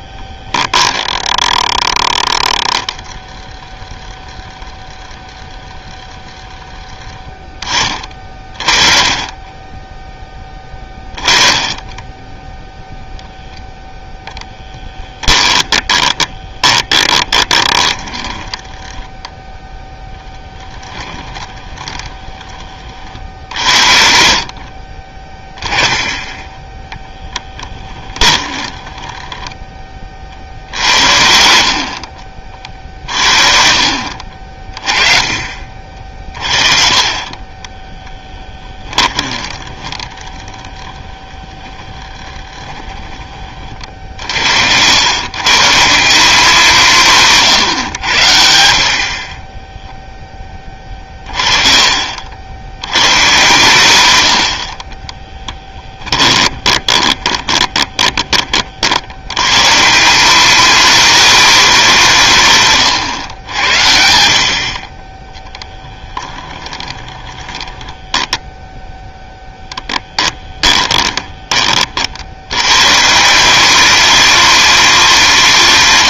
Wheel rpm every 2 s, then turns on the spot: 10, 10, 10, 10, 30, 20, 0, 10, 30, 10, 10, 40, 40, 10, 20, 70, 50, 30, 30, 20, 10, 20, 90, 180, 50, 20, 100, 30, 20, 70, 220, 130, 40, 20, 10, 20, 130, 200.
14-22 24-26 28-30 38-40 42-44 56-58 66-72